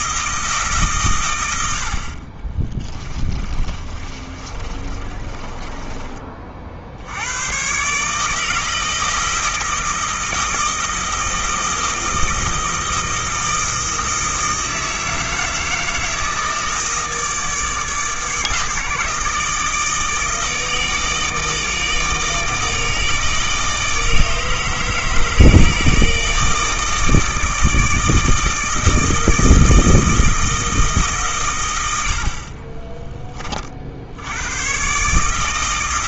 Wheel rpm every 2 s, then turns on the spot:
150, 20, 30, 60, 160, 160, 160, 160, 160, 160, 160, 160, 160, 160, 160, 160, 30, 110.
2-6